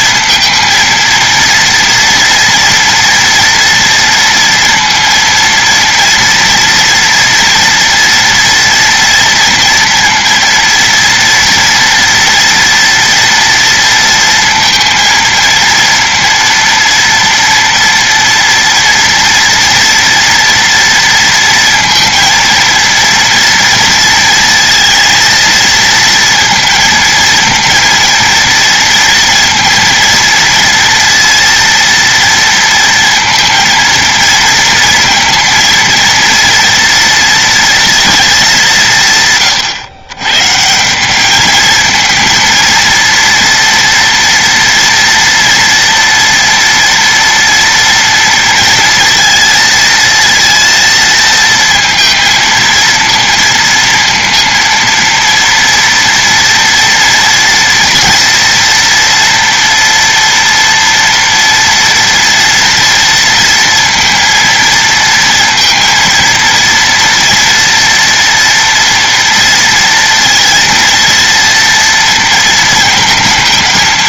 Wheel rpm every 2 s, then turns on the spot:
230, 230, 230, 230, 230, 230, 230, 230, 230, 230, 230, 230, 230, 230, 230, 230, 230, 230, 230, 170, 180, 230, 240, 230, 230, 230, 230, 230, 230, 230, 230, 230, 230, 230, 230, 230, 230.
none